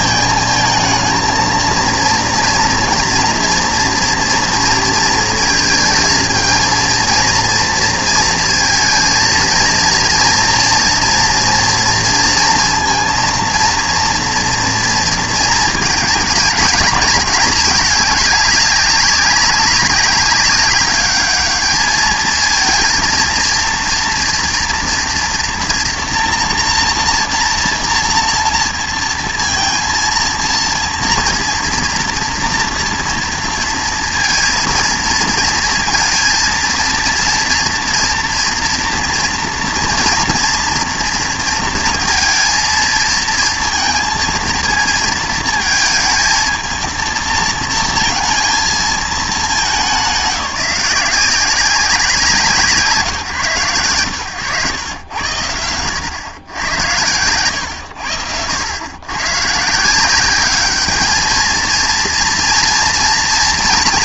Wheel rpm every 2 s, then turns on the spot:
220, 230, 230, 230, 230, 230, 230, 230, 210, 200, 200, 230, 240, 230, 230, 230, 230, 230, 230, 230, 230, 230, 230, 220, 230, 170, 180, 110, 100, 90, 200, 230.
none